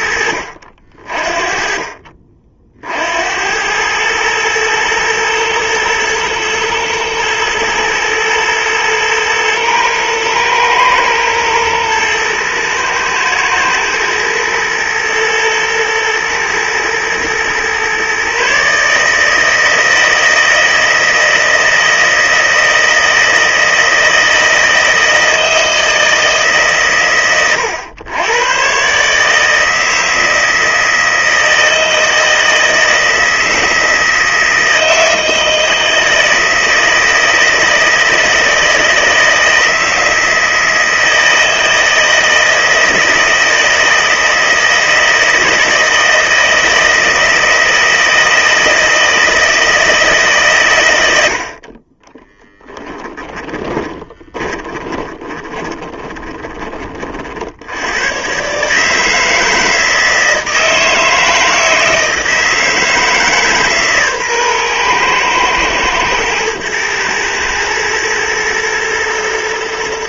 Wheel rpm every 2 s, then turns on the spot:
60, 80, 120, 110, 110, 110, 120, 120, 110, 150, 160, 160, 160, 120, 130, 160, 160, 160, 160, 160, 160, 160, 160, 160, 160, 110, 10, 20, 40, 150, 160, 160, 120, 110, 120.
52-56